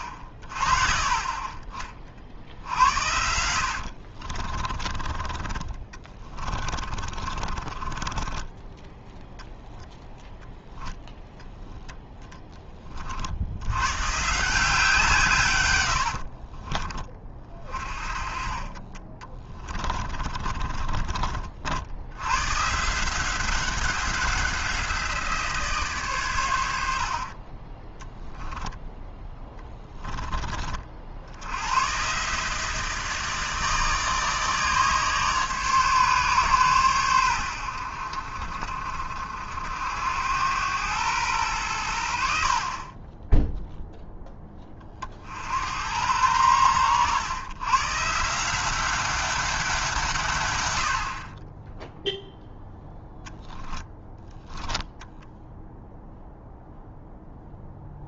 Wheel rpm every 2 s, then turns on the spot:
40, 70, 40, 30, 10, 0, 10, 160, 30, 30, 40, 130, 180, 100, 10, 40, 160, 150, 130, 50, 100, 50, 20, 100, 180, 100, 0, 10, 0.
4-10 16-18 20-22 42-44